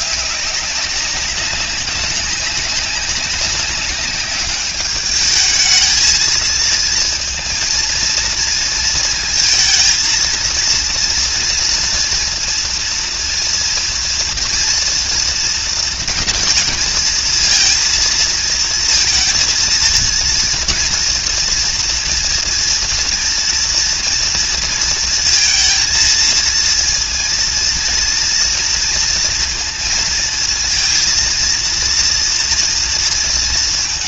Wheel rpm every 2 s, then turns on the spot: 200, 190, 200, 220, 230, 230, 230, 230, 230, 230, 240, 230, 230, 230, 230, 230, 230.
none